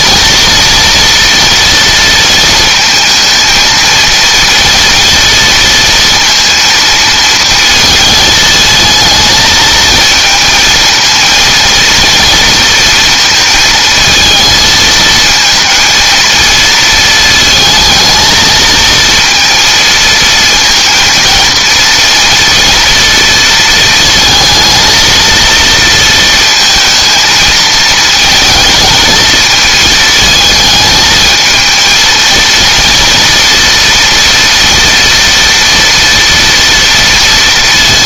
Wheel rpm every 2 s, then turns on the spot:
230, 220, 230, 230, 220, 230, 230, 220, 220, 230, 230, 230, 230, 220, 230, 220, 230, 240, 230.
none